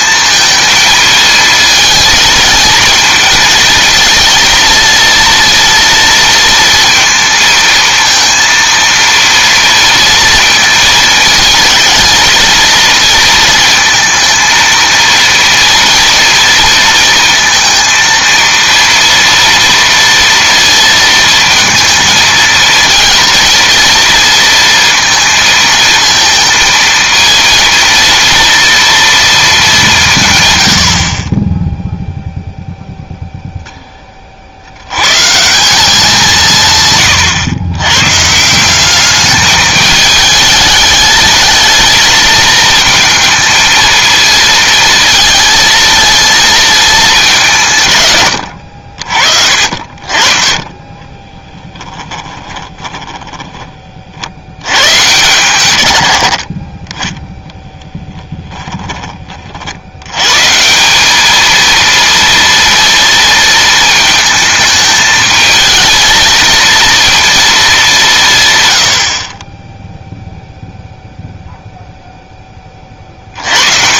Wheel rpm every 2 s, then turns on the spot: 220, 230, 230, 230, 230, 230, 230, 230, 230, 230, 230, 220, 230, 220, 230, 100, 0, 70, 150, 180, 210, 220, 230, 230, 90, 30, 20, 90, 30, 10, 160, 230, 220, 230, 140, 0, 20.
52-54 58-60